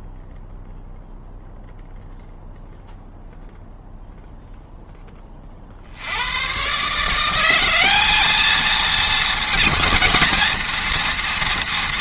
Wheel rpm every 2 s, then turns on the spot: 0, 0, 10, 140, 220, 230.
none